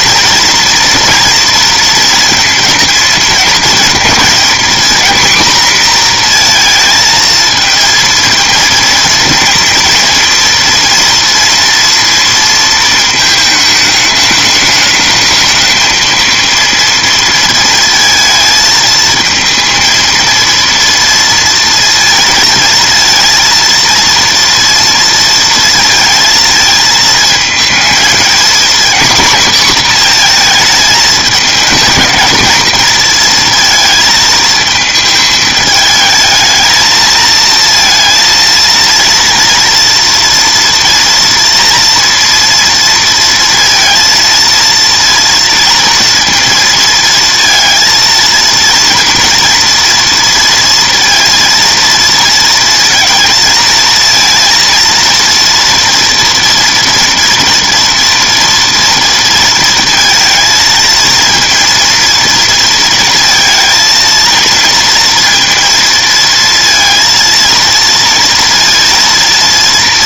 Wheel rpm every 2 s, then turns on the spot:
230, 230, 240, 230, 230, 230, 230, 210, 230, 220, 230, 230, 230, 220, 240, 230, 220, 220, 220, 230, 230, 230, 230, 230, 230, 230, 230, 230, 230, 230, 230, 230, 230, 230, 230.
none